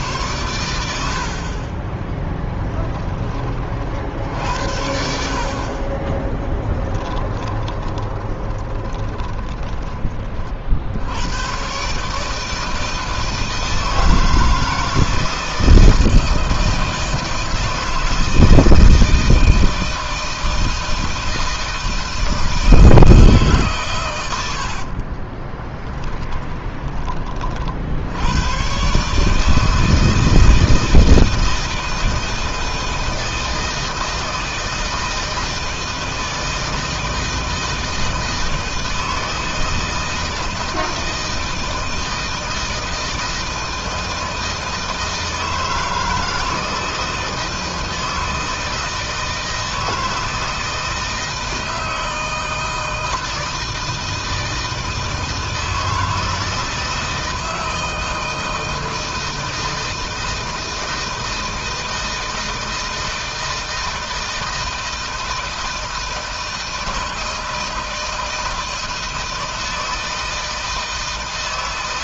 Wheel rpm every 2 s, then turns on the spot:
90, 10, 70, 20, 30, 70, 160, 160, 160, 160, 160, 160, 60, 20, 120, 160, 160, 160, 160, 160, 160, 160, 160, 160, 160, 160, 160, 160, 160, 160, 160, 160, 160, 160, 160, 160.
6-10 24-26